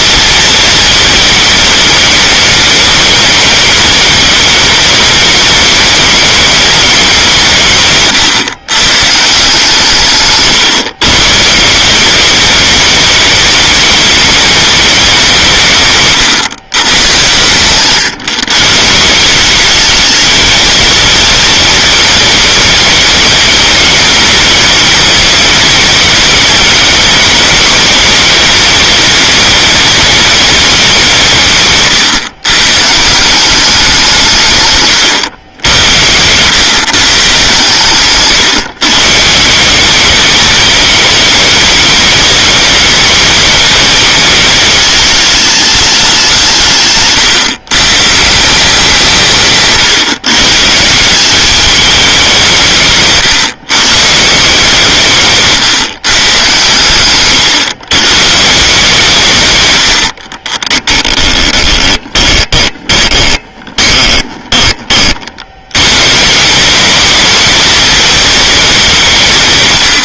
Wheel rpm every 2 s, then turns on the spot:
230, 210, 200, 210, 130, 130, 200, 210, 110, 150, 220, 210, 210, 220, 210, 200, 130, 150, 120, 140, 200, 210, 210, 160, 170, 150, 170, 160, 120, 140, 30, 20, 20, 190, 210.
10-12 60-64